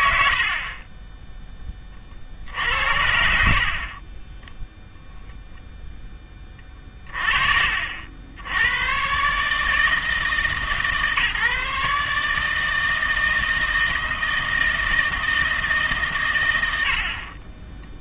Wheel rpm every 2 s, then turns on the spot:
70, 60, 0, 30, 90, 150, 160, 160, 90.
none